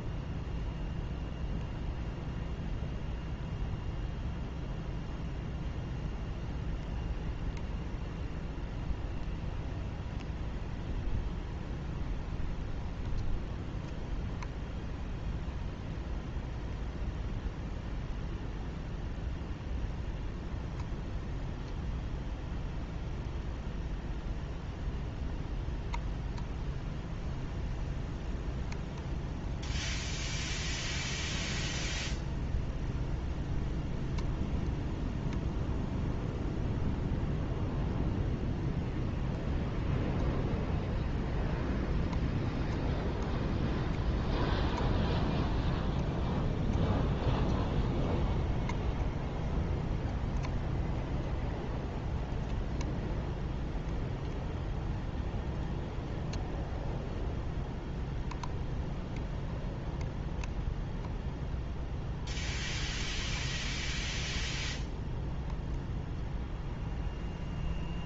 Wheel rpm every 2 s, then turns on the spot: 0, 0, 0, 0, 0, 0, 0, 0, 0, 0, 0, 0, 0, 0, 0, 0, 0, 0, 0, 0, 0, 0, 0, 0, 0, 0, 0, 0, 0, 0, 0, 0, 0, 0.
none